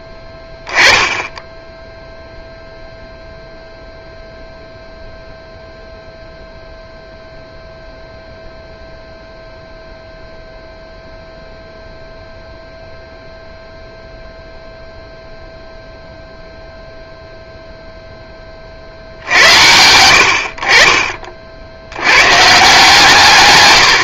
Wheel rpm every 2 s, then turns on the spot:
10, 0, 0, 0, 0, 0, 0, 0, 0, 40, 40, 160.
none